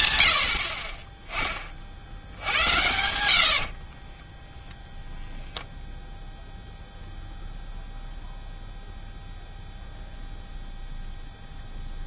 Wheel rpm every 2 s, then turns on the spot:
40, 90, 0, 0, 0, 0.
none